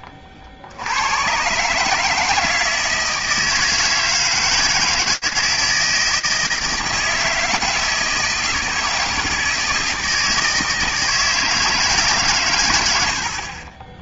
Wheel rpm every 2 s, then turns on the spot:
70, 160, 160, 160, 160, 160, 70.
none